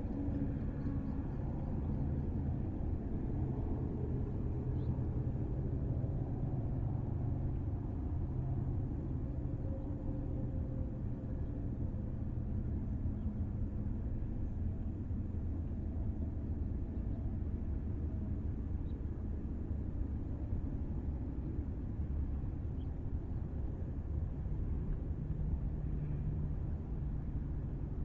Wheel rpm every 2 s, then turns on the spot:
0, 0, 0, 0, 0, 0, 0, 0, 0, 0, 0, 0, 0, 0.
none